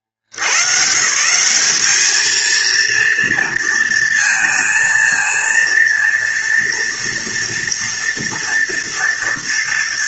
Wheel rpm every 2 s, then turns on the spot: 60, 220, 230, 230, 230.
none